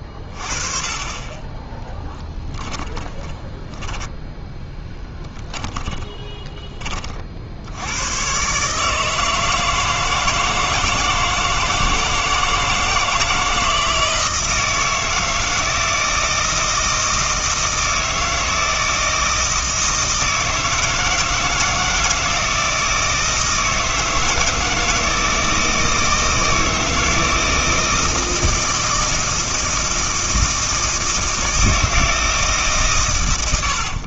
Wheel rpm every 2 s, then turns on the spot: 30, 20, 10, 30, 150, 160, 160, 160, 160, 160, 160, 160, 160, 160, 160, 160, 140.
2-6